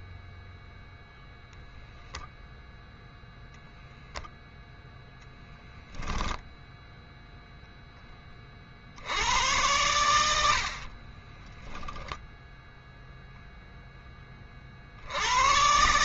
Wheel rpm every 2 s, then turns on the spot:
0, 0, 0, 0, 50, 60, 0, 50.
10-12